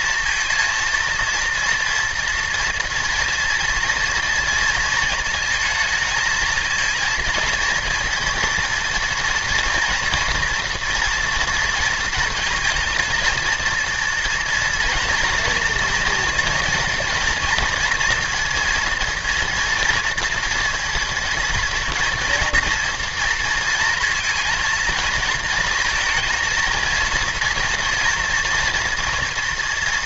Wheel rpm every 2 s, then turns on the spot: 230, 230, 230, 230, 230, 230, 230, 240, 240, 230, 230, 230, 230, 230, 230.
none